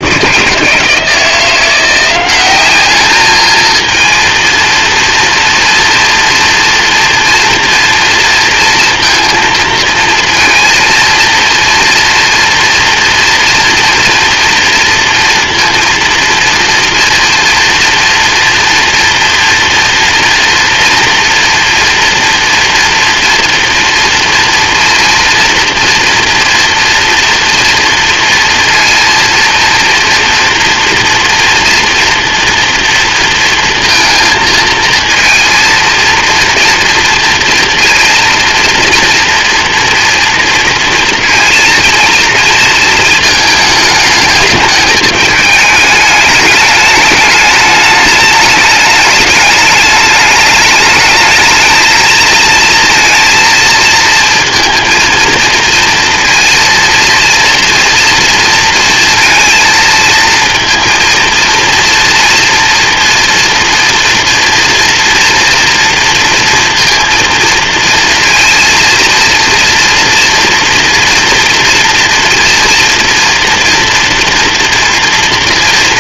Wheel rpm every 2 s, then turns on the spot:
170, 210, 230, 230, 230, 230, 230, 230, 230, 230, 230, 230, 230, 240, 230, 230, 230, 230, 230, 230, 230, 220, 210, 210, 210, 220, 230, 230, 230, 230, 230, 230, 240, 230, 230, 230, 230, 230.
none